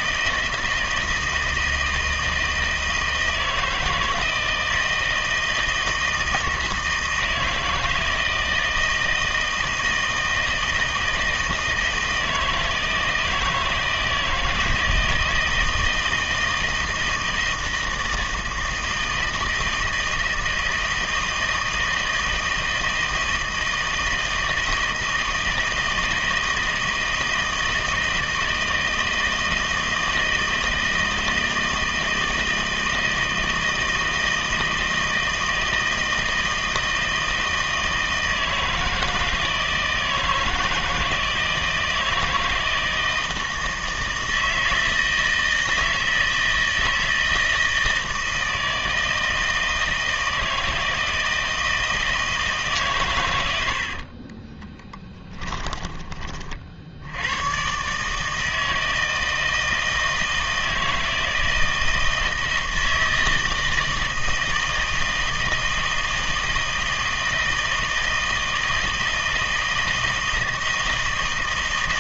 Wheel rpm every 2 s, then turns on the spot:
160, 160, 160, 160, 160, 160, 160, 160, 160, 160, 160, 160, 160, 160, 160, 160, 160, 160, 160, 160, 160, 160, 160, 160, 160, 160, 150, 20, 50, 160, 160, 160, 160, 160, 160, 160.
54-56